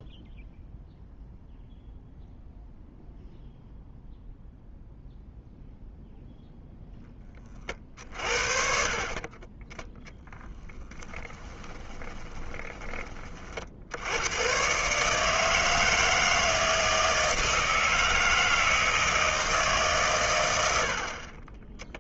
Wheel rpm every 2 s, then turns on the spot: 0, 0, 0, 0, 50, 10, 20, 120, 160, 160, 90.
10-14